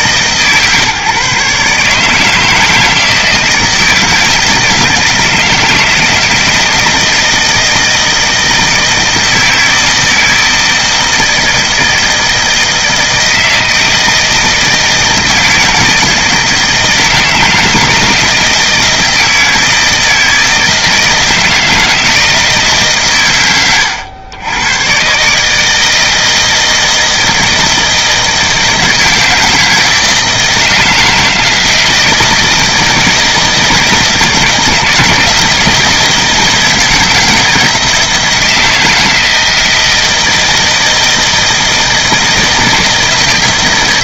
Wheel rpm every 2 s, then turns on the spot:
150, 160, 160, 160, 160, 160, 160, 160, 160, 160, 160, 100, 140, 160, 160, 160, 160, 160, 160, 160, 160, 160.
none